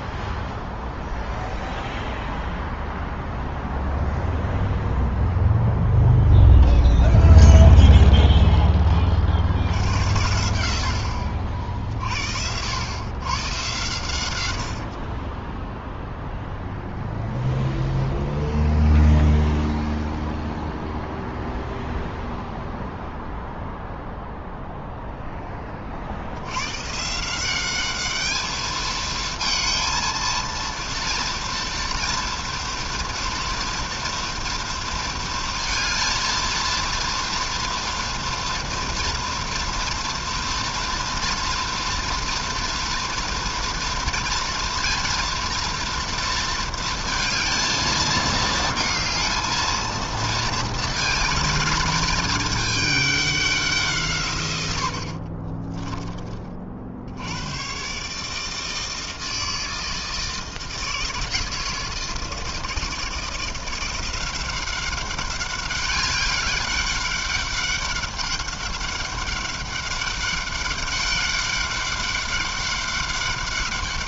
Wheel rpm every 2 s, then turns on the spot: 0, 0, 0, 0, 50, 50, 120, 30, 0, 0, 0, 0, 10, 170, 220, 230, 230, 230, 230, 230, 230, 230, 230, 230, 220, 230, 200, 50, 90, 160, 160, 160, 200, 200, 200, 200, 200.
54-56